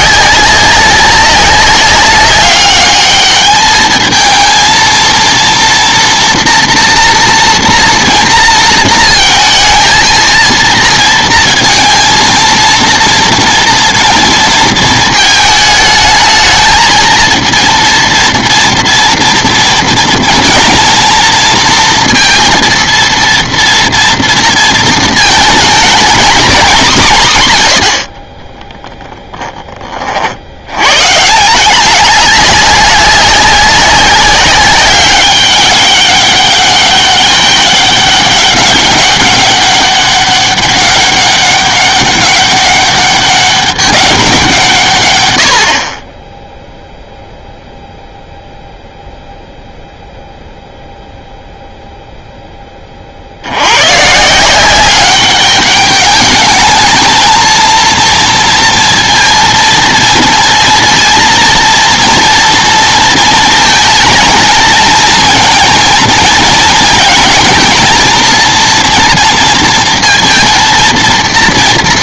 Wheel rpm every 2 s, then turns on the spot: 190, 210, 230, 240, 230, 230, 230, 230, 230, 230, 230, 230, 220, 230, 10, 120, 200, 200, 200, 200, 200, 200, 150, 0, 0, 0, 20, 180, 210, 230, 230, 230, 230, 230, 230, 230.
28-30